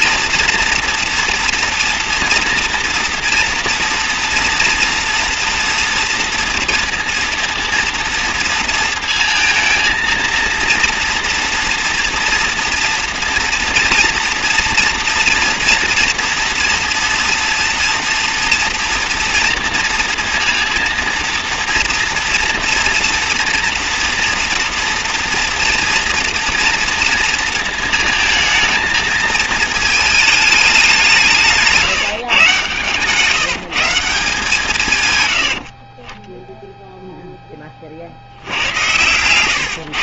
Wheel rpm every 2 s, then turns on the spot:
230, 240, 240, 240, 230, 230, 230, 230, 230, 230, 230, 230, 230, 230, 220, 210, 130, 160, 10, 100.
none